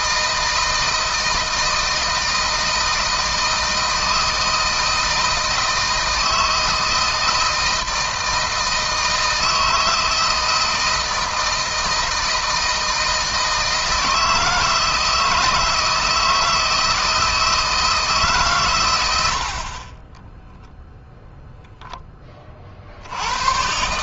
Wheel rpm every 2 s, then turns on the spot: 160, 160, 160, 160, 160, 160, 160, 160, 160, 100, 0, 60.
none